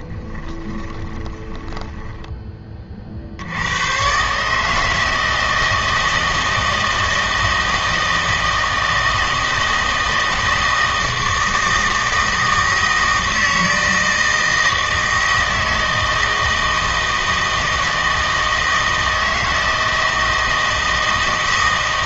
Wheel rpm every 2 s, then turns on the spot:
20, 20, 150, 160, 160, 160, 160, 160, 160, 160, 160.
0-2